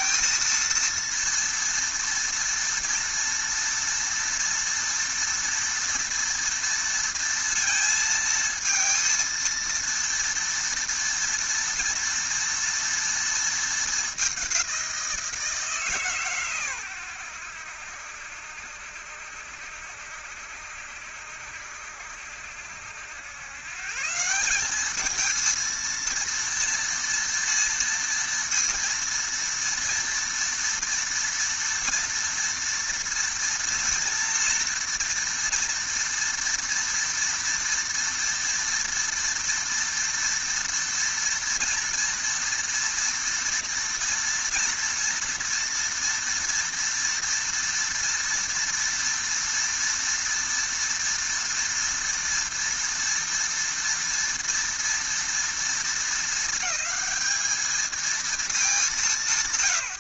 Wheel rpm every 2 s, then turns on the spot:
230, 230, 240, 230, 230, 230, 230, 190, 110, 70, 70, 80, 200, 230, 230, 230, 230, 230, 240, 230, 230, 230, 230, 230, 230, 230, 230, 230, 220, 200.
none